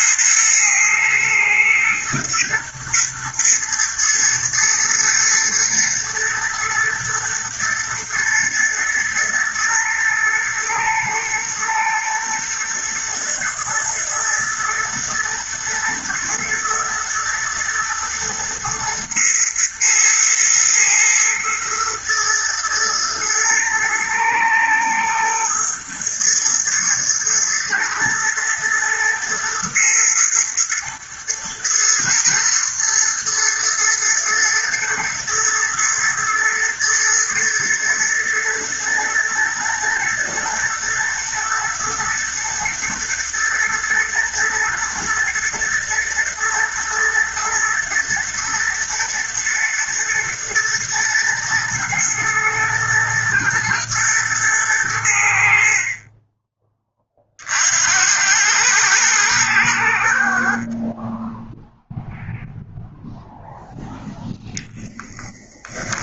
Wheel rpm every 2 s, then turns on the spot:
110, 110, 110, 120, 120, 110, 120, 120, 110, 110, 110, 110, 110, 120, 120, 110, 120, 110, 110, 110, 110, 120, 110, 120, 120, 110, 120, 90, 30, 110, 30, 0, 10.
none